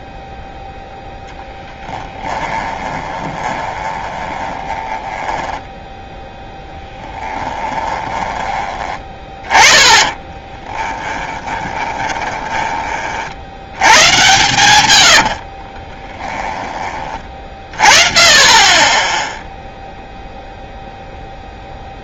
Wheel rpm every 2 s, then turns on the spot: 0, 20, 20, 0, 20, 20, 20, 120, 10, 20, 0.
2-6 10-16